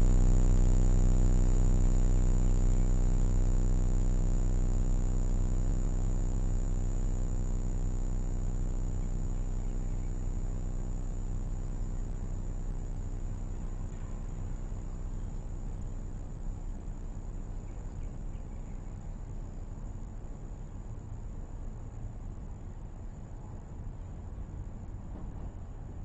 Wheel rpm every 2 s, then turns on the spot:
0, 0, 0, 0, 0, 0, 0, 0, 0, 0, 0, 0, 0.
none